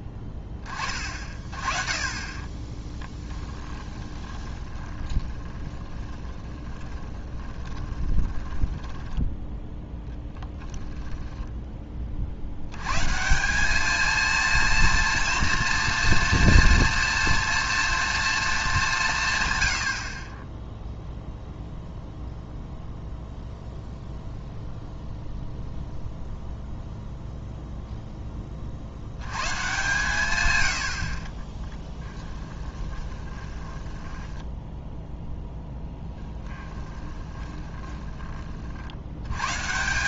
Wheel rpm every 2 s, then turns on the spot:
20, 30, 30, 20, 10, 10, 100, 230, 230, 200, 10, 0, 0, 0, 30, 90, 10, 10, 10, 60.
2-10 32-34 36-38